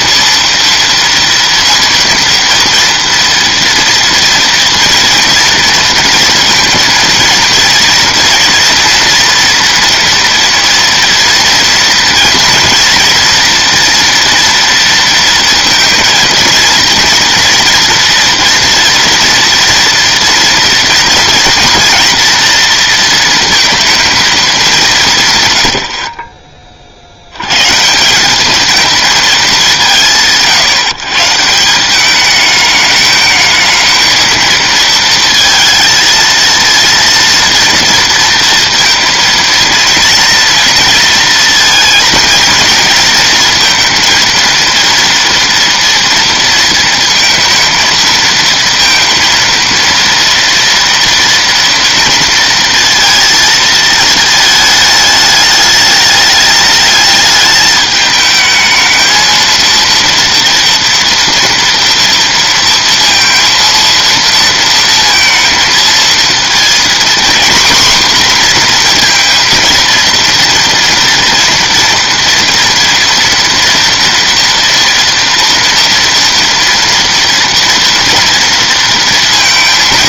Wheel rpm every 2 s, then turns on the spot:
230, 230, 230, 230, 230, 230, 230, 230, 230, 230, 230, 230, 210, 30, 220, 150, 210, 230, 230, 230, 230, 230, 230, 230, 230, 230, 230, 220, 210, 220, 230, 230, 230, 240, 240, 230, 230, 230, 230, 230.
none